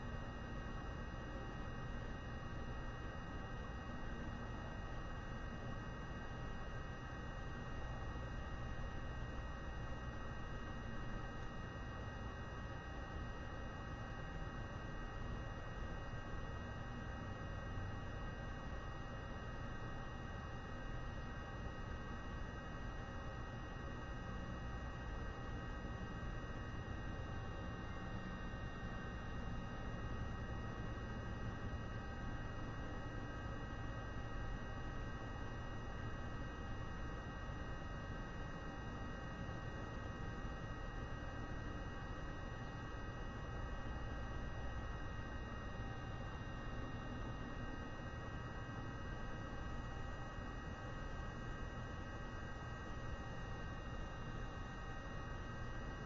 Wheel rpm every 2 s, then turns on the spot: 0, 0, 0, 0, 0, 0, 0, 0, 0, 0, 0, 0, 0, 0, 0, 0, 0, 0, 0, 0, 0, 0, 0, 0, 0, 0, 0, 0.
none